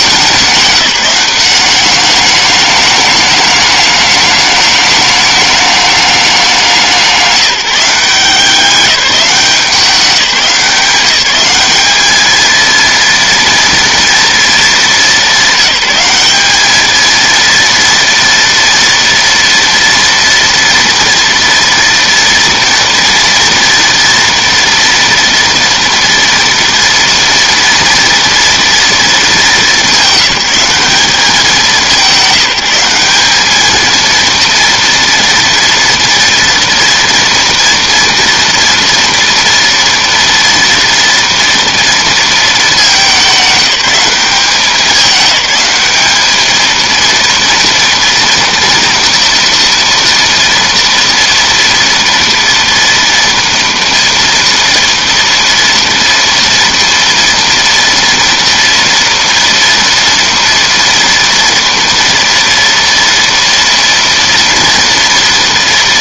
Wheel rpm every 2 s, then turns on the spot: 200, 210, 210, 180, 190, 190, 230, 210, 220, 230, 240, 230, 230, 240, 220, 190, 180, 230, 230, 230, 230, 200, 200, 230, 230, 230, 230, 230, 230, 230, 230, 230, 240.
none